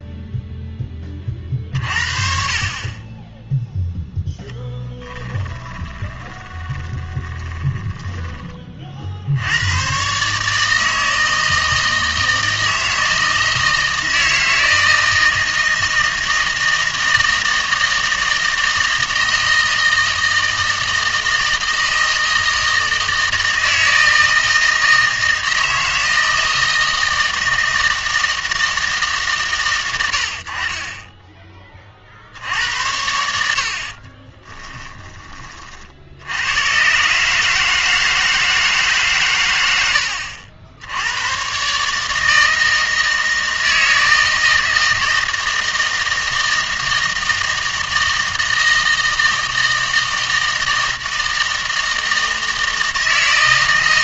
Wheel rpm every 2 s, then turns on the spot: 10, 30, 10, 20, 40, 150, 160, 160, 160, 160, 160, 160, 160, 160, 160, 30, 90, 20, 130, 150, 80, 160, 160, 160, 160, 160, 160.
4-8 34-36